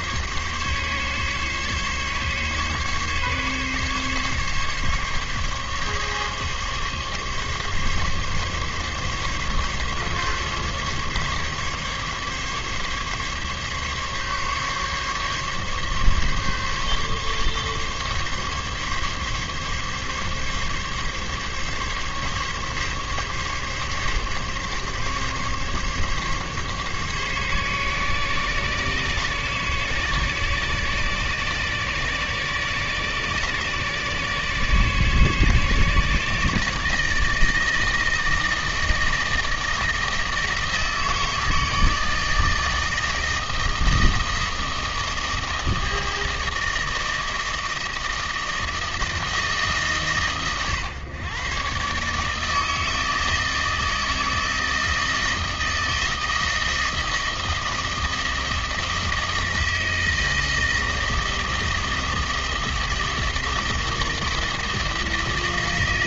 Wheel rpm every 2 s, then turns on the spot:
140, 140, 140, 140, 140, 140, 140, 140, 140, 140, 140, 140, 140, 140, 140, 140, 140, 140, 150, 160, 160, 160, 160, 160, 160, 120, 160, 160, 160, 160, 160, 160, 160.
none